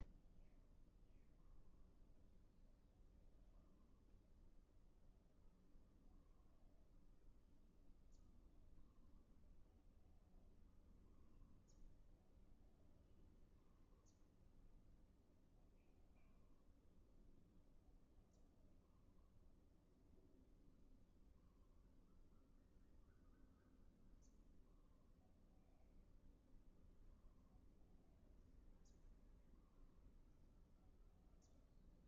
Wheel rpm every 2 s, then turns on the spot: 0, 0, 0, 0, 0, 0, 0, 0, 0, 0, 0, 0, 0, 0, 0, 0.
none